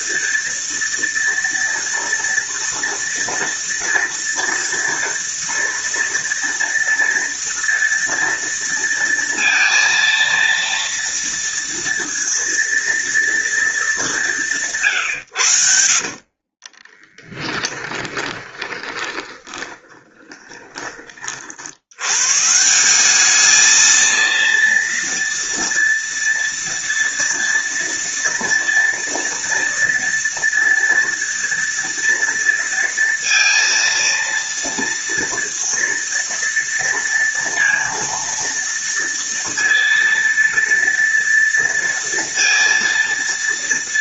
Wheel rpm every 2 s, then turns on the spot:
230, 230, 230, 230, 230, 230, 230, 170, 40, 20, 20, 160, 230, 230, 230, 230, 230, 230, 230, 230, 230, 230.
16-22